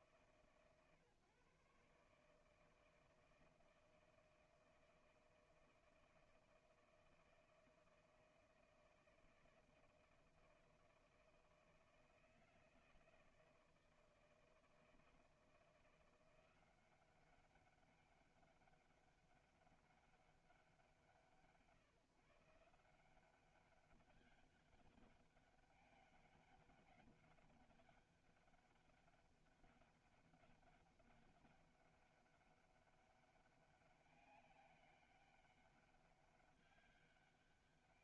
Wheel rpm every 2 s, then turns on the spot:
140, 160, 160, 160, 160, 160, 160, 160, 180, 200, 190, 160, 200, 200, 200, 200, 200, 190, 200.
none